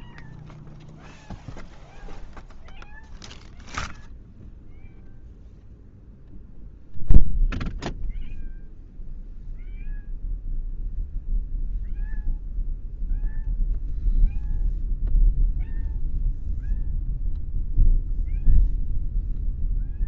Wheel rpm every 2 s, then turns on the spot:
0, 0, 0, 0, 0, 0, 0, 0, 0, 0.
none